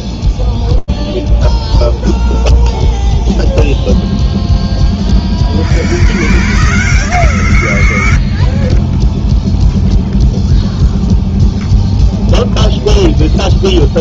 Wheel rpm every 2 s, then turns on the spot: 0, 0, 120, 90, 0, 0, 0.
none